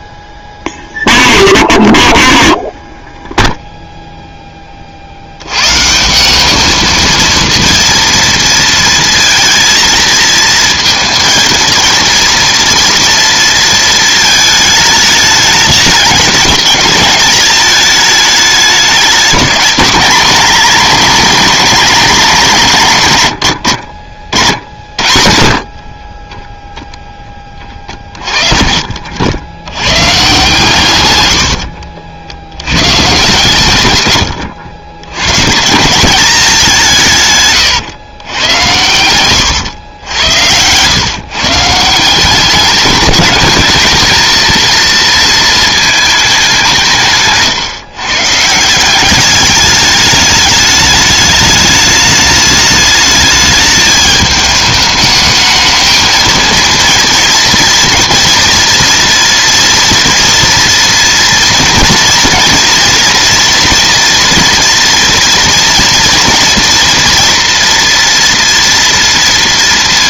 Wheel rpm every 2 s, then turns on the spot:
0, 0, 20, 210, 230, 230, 240, 220, 210, 210, 200, 180, 80, 10, 40, 140, 100, 90, 180, 100, 100, 190, 230, 180, 160, 210, 210, 210, 230, 240, 230, 230, 230, 230, 230.
28-30